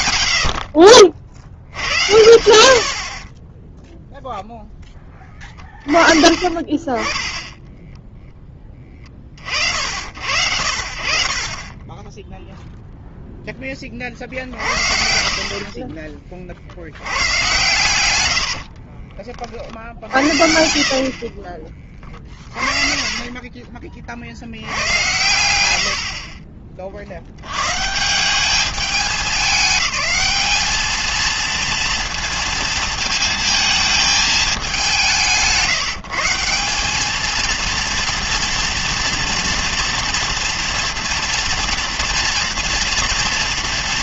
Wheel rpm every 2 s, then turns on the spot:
50, 30, 20, 20, 30, 50, 0, 40, 60, 60, 60, 40, 80, 30, 200, 220, 230, 200, 180, 230, 230, 230.
18-22